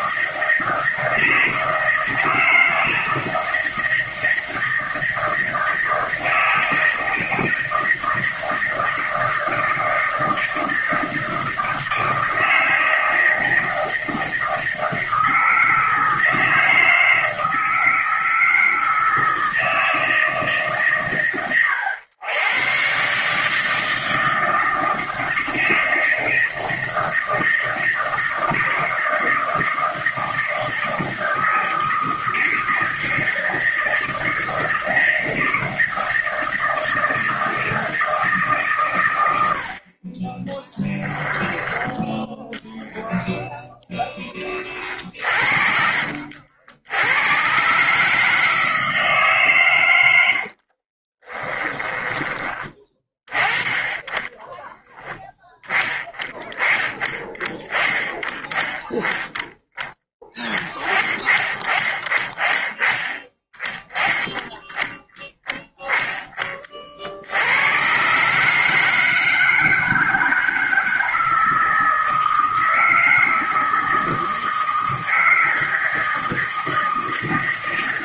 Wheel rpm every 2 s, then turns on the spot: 160, 160, 160, 160, 160, 160, 160, 160, 160, 160, 130, 140, 160, 160, 160, 160, 160, 160, 160, 110, 10, 0, 40, 90, 150, 30, 20, 10, 20, 10, 20, 20, 10, 60, 160, 160, 160, 160, 160.
44-46 50-52